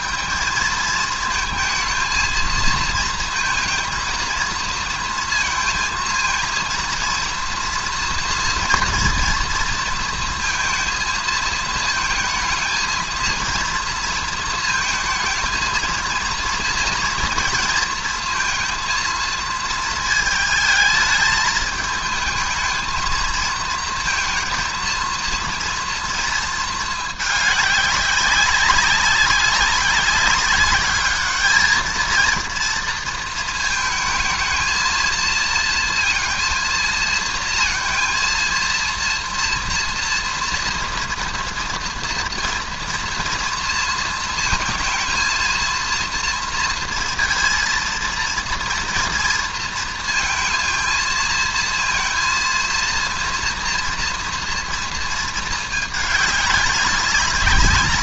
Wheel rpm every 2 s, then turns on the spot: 220, 230, 230, 230, 230, 230, 230, 220, 230, 230, 220, 220, 230, 230, 200, 200, 230, 220, 230, 230, 230, 230, 230, 230, 230, 230, 230, 230, 200.
none